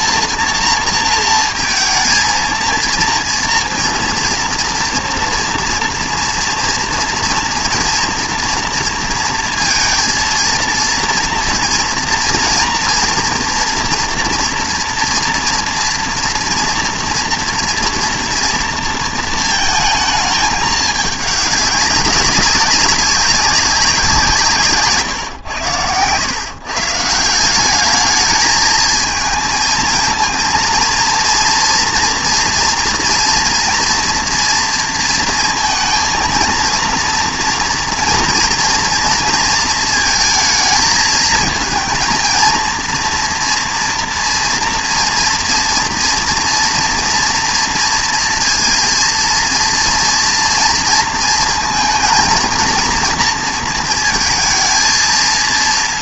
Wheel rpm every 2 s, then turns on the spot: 230, 230, 240, 230, 230, 230, 230, 230, 230, 230, 210, 190, 160, 140, 220, 230, 240, 230, 230, 230, 220, 230, 230, 240, 230, 230, 230, 230.
none